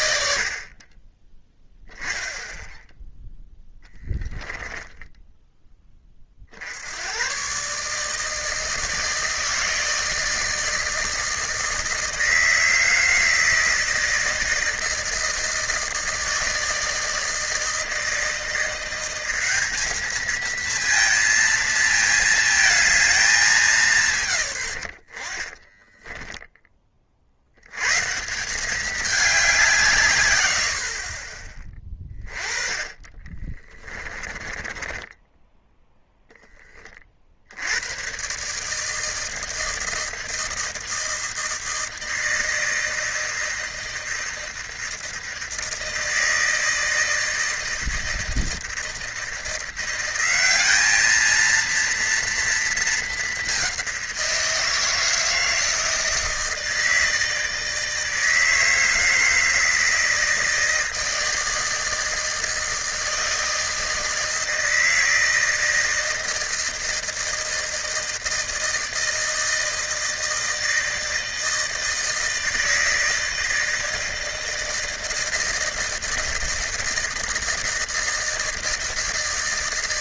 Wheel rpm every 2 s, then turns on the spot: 50, 0, 10, 70, 160, 160, 160, 160, 160, 170, 230, 220, 100, 40, 200, 60, 20, 20, 30, 150, 160, 160, 160, 160, 160, 210, 220, 160, 160, 160, 160, 160, 160, 160, 160, 160, 160, 160, 160, 160.
4-6 24-26 32-36